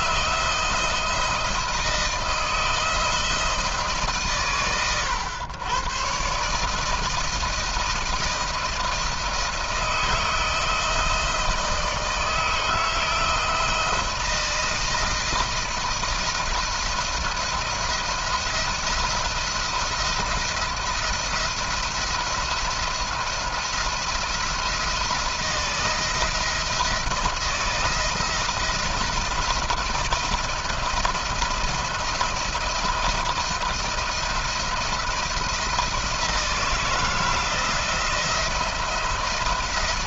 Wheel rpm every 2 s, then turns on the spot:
160, 170, 100, 150, 170, 160, 160, 160, 170, 170, 170, 170, 170, 160, 170, 170, 170, 170, 170, 170.
none